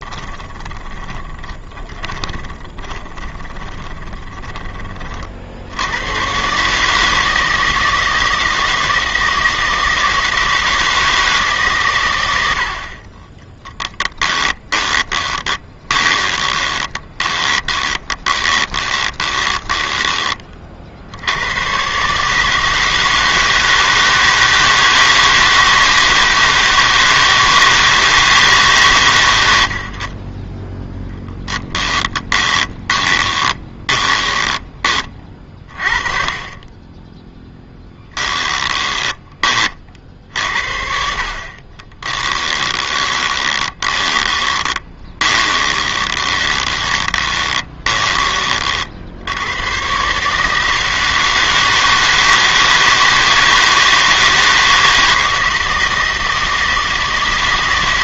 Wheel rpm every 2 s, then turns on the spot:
10, 30, 20, 140, 160, 160, 70, 20, 20, 20, 40, 160, 160, 160, 140, 20, 20, 20, 20, 20, 60, 20, 20, 20, 40, 150, 160, 160, 160.
0-4 14-20 32-34 38-40 42-48